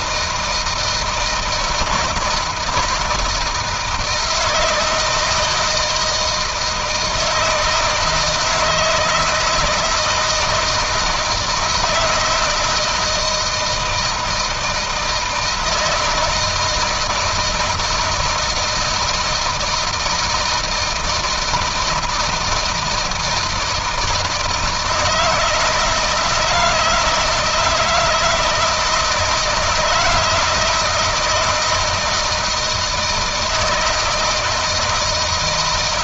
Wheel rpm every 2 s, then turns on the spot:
160, 160, 170, 160, 160, 160, 160, 160, 160, 160, 160, 160, 160, 160, 170, 160, 160, 160.
none